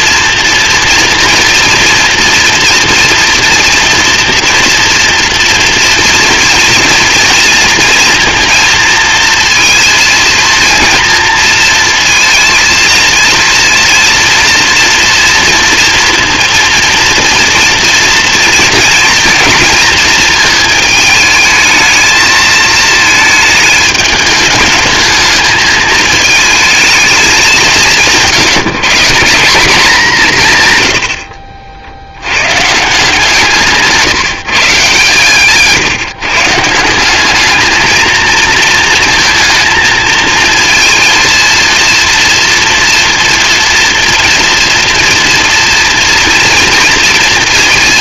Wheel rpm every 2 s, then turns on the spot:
230, 230, 230, 230, 230, 230, 230, 230, 230, 230, 220, 220, 210, 220, 170, 140, 140, 140, 160, 220, 230, 230, 230, 230.
none